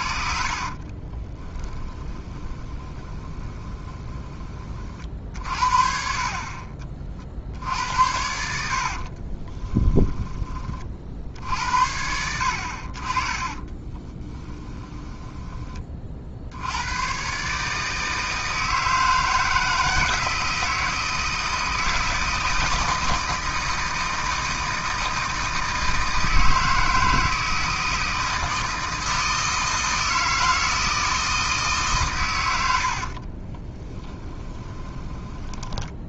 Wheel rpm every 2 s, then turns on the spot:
40, 20, 30, 40, 70, 30, 60, 10, 90, 160, 160, 160, 160, 160, 160, 160, 90, 20.
0-4 8-10 14-16 32-36